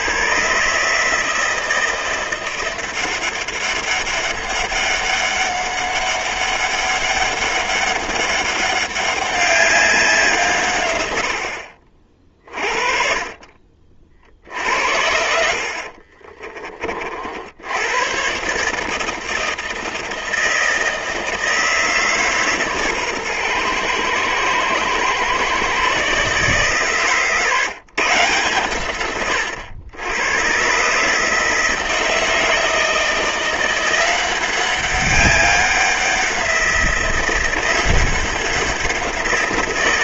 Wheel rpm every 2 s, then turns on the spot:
140, 180, 200, 200, 200, 120, 40, 60, 40, 150, 160, 140, 120, 140, 110, 140, 160, 190, 180, 180.
none